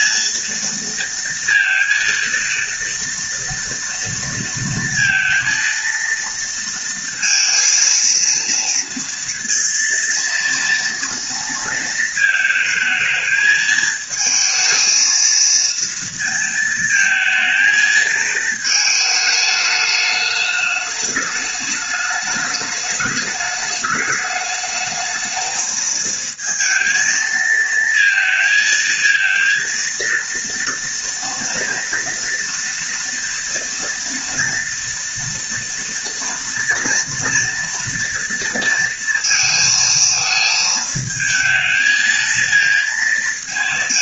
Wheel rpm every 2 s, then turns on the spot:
230, 230, 230, 230, 230, 230, 220, 220, 230, 220, 210, 210, 210, 230, 230, 230, 230, 230, 230, 230, 220, 230.
none